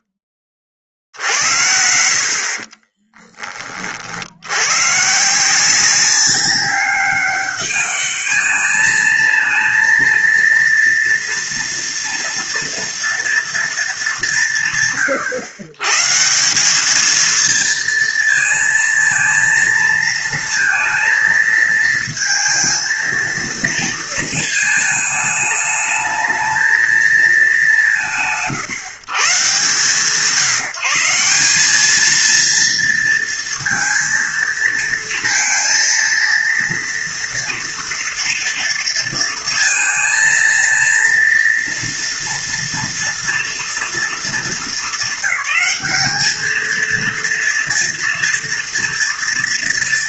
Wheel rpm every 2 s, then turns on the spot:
50, 20, 170, 200, 220, 230, 230, 120, 220, 230, 220, 230, 210, 200, 130, 200, 230, 230, 230, 230, 230, 230, 200, 230, 230.
none